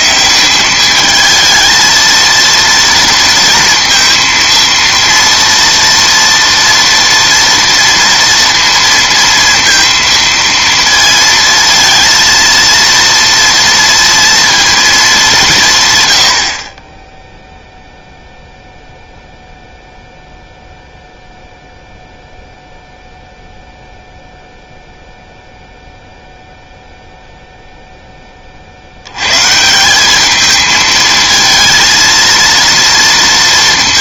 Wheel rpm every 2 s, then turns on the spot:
190, 230, 230, 230, 230, 230, 230, 220, 30, 0, 0, 0, 0, 0, 60, 220, 230.
none